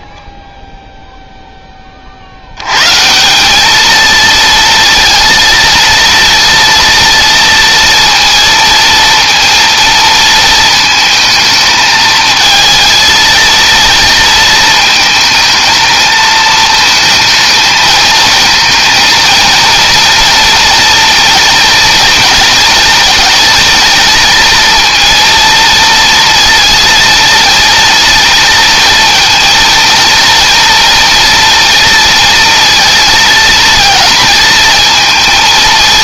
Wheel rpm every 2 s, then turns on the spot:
0, 120, 230, 230, 230, 220, 230, 220, 220, 230, 230, 230, 230, 230, 230, 230, 230, 230.
none